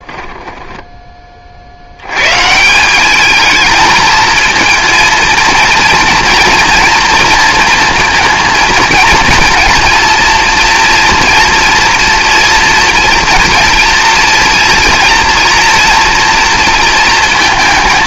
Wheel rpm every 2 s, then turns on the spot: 10, 180, 230, 230, 230, 230, 240, 230, 230.
none